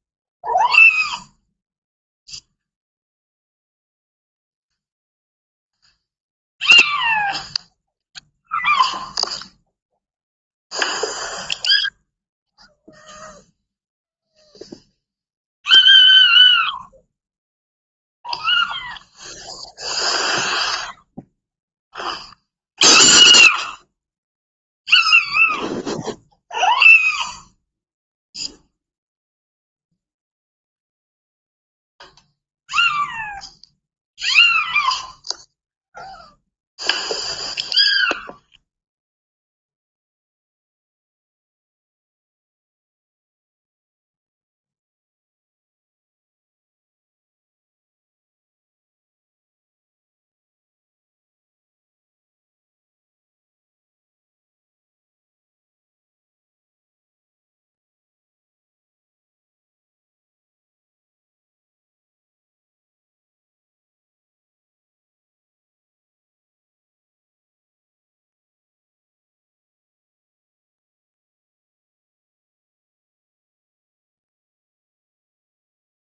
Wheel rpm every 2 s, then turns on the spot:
0, 0, 0, 0, 0, 0, 0, 0, 0, 0, 0, 0, 0, 0, 0, 0, 0, 0, 0, 0, 0, 0, 0, 0, 0, 0, 0, 0, 0, 0, 0, 0, 0, 0, 0, 0, 0, 0.
none